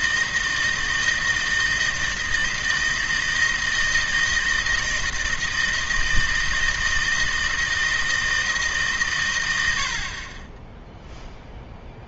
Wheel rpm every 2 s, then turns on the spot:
160, 160, 160, 160, 160, 30.
none